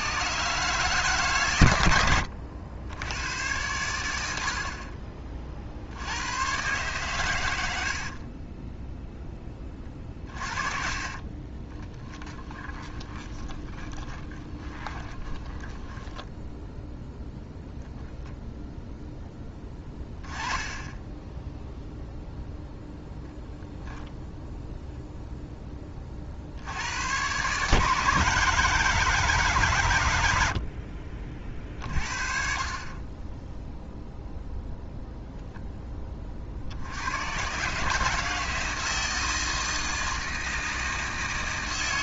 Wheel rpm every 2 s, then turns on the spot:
150, 90, 50, 120, 20, 40, 10, 20, 0, 0, 20, 0, 0, 80, 160, 60, 40, 0, 70, 160, 160.
4-6 8-16 20-22